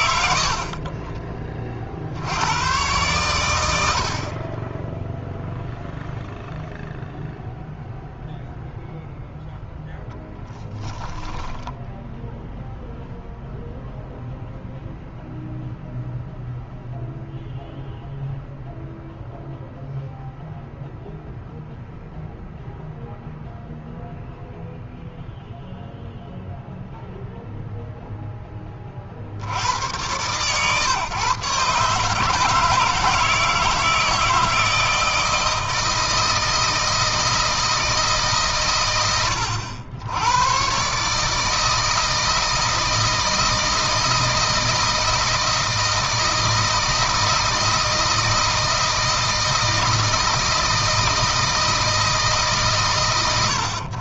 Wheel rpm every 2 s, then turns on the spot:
50, 100, 10, 0, 0, 10, 0, 0, 0, 0, 0, 0, 0, 0, 30, 130, 150, 160, 160, 110, 130, 160, 160, 160, 160, 160, 130.
10-12